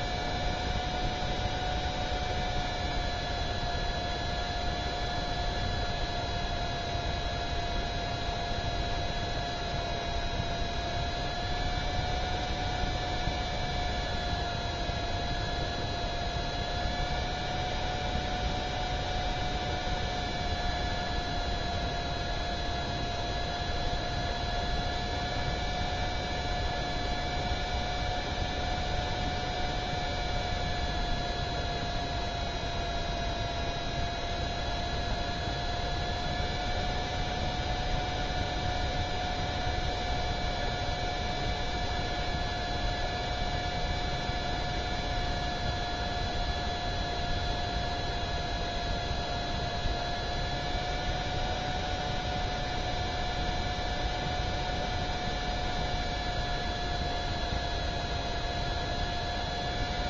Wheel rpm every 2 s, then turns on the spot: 0, 0, 0, 0, 0, 0, 0, 0, 0, 0, 0, 0, 0, 0, 0, 0, 0, 0, 0, 0, 0, 0, 0, 0, 0, 0, 0, 0, 0, 0.
none